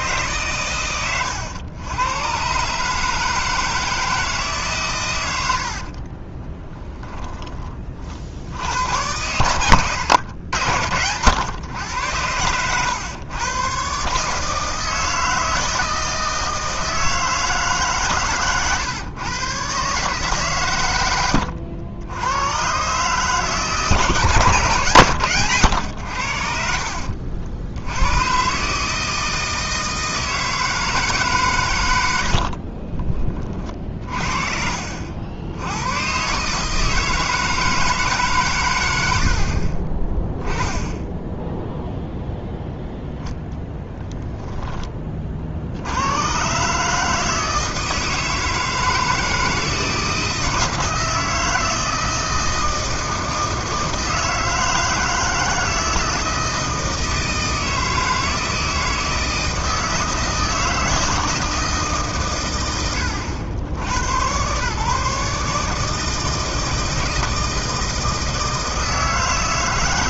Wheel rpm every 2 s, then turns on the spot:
120, 140, 140, 20, 80, 90, 100, 160, 160, 120, 120, 120, 140, 80, 140, 160, 50, 50, 150, 100, 10, 0, 20, 140, 160, 160, 160, 160, 160, 160, 160, 100, 130, 160, 160.
6-8 26-28 32-34